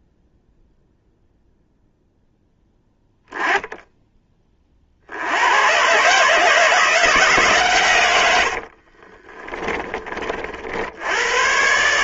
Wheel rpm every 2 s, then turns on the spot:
0, 0, 30, 150, 70, 50.
8-10